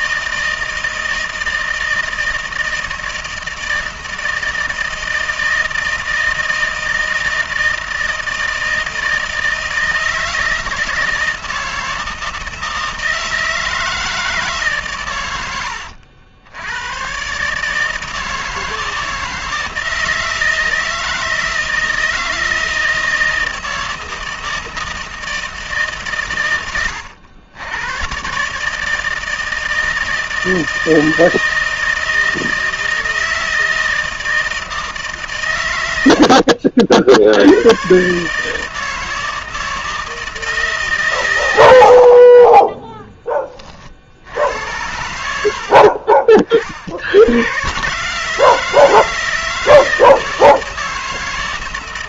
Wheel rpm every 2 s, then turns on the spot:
160, 160, 160, 160, 160, 160, 160, 140, 90, 160, 160, 160, 160, 100, 150, 160, 160, 160, 60, 160, 160, 20, 80, 50, 160, 160.
36-38